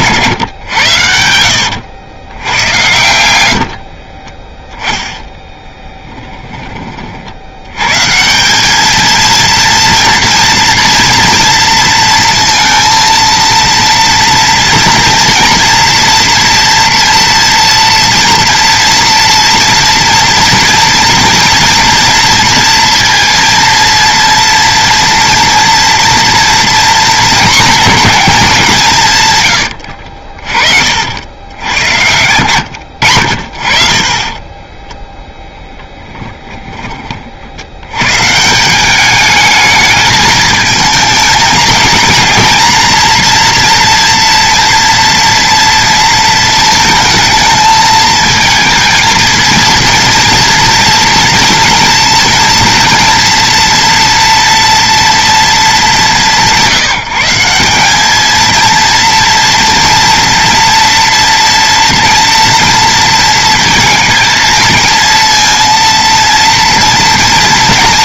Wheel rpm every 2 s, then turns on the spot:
110, 100, 10, 20, 200, 230, 230, 230, 230, 230, 230, 230, 230, 230, 200, 50, 100, 20, 30, 170, 220, 230, 230, 230, 220, 230, 230, 240, 170, 220, 230, 230, 220, 230.
0-2 4-6 32-38